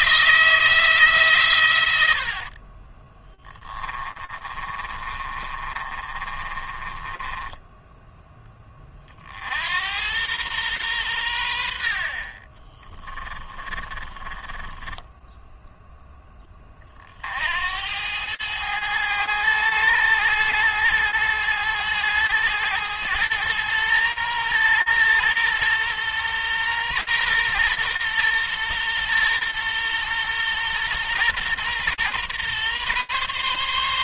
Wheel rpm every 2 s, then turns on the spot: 160, 50, 30, 20, 20, 110, 30, 10, 30, 100, 110, 110, 120, 120, 120, 120, 130.
2-8 12-14